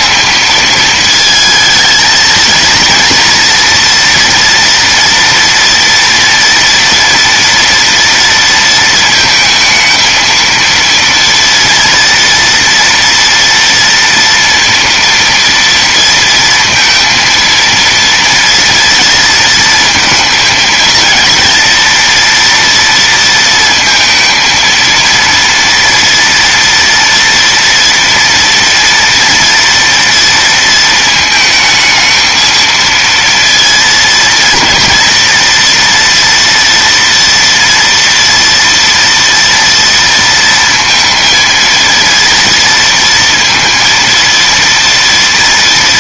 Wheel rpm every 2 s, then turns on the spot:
220, 230, 230, 230, 230, 230, 230, 230, 230, 230, 230, 230, 230, 230, 230, 220, 230, 230, 240, 230, 230, 230, 230.
none